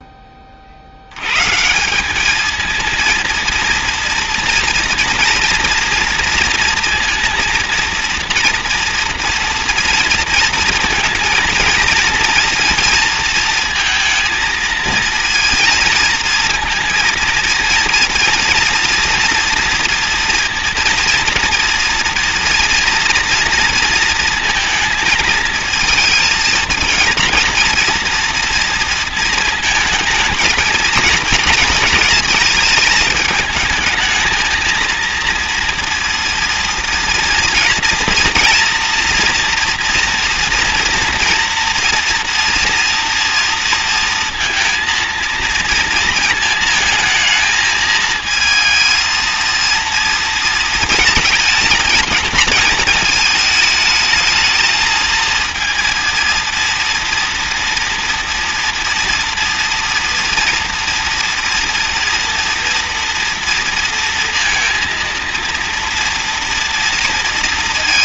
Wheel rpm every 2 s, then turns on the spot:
20, 220, 230, 230, 230, 230, 230, 220, 230, 230, 230, 230, 230, 220, 230, 220, 220, 220, 230, 230, 230, 240, 230, 220, 230, 230, 220, 220, 230, 240, 240, 230, 230, 230.
none